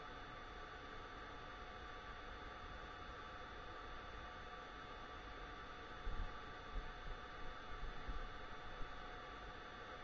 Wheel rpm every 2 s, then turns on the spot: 0, 0, 0, 0, 0.
none